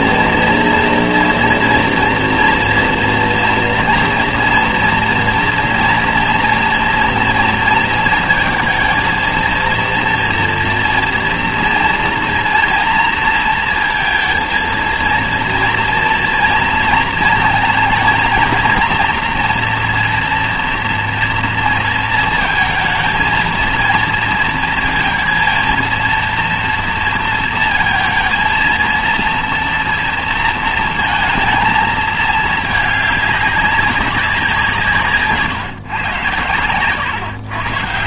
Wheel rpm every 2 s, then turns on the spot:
240, 240, 230, 230, 230, 230, 230, 230, 230, 230, 230, 220, 230, 230, 230, 230, 220, 170, 120.
36-38